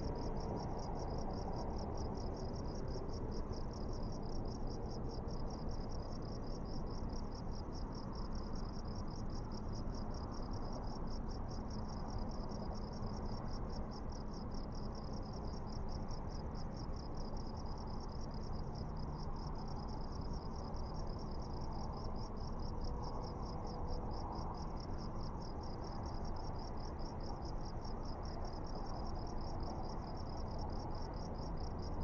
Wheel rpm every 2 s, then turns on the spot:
0, 0, 0, 0, 0, 0, 0, 0, 0, 0, 0, 0, 0, 0, 0, 0.
none